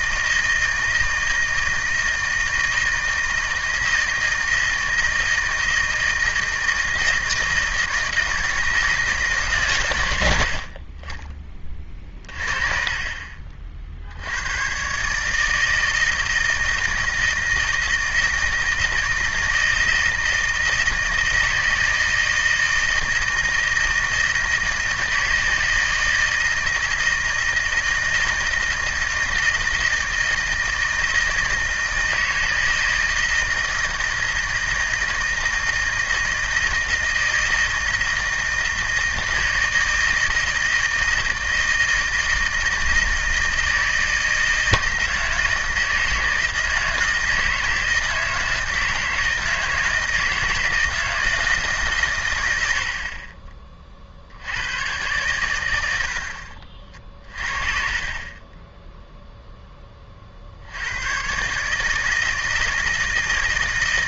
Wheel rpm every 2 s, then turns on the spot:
160, 160, 160, 160, 160, 70, 40, 110, 160, 160, 160, 160, 160, 160, 160, 160, 160, 160, 160, 160, 160, 160, 160, 160, 160, 160, 100, 90, 50, 20, 70, 160.
56-58